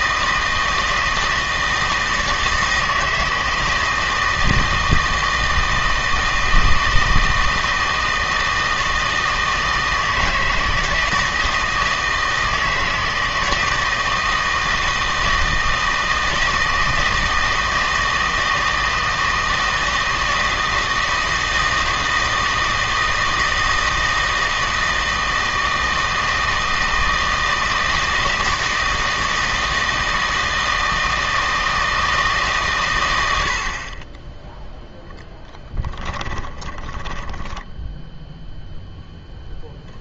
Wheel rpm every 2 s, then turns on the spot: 160, 160, 160, 160, 160, 160, 160, 160, 160, 160, 160, 160, 160, 160, 160, 160, 140, 0, 10, 0.
36-38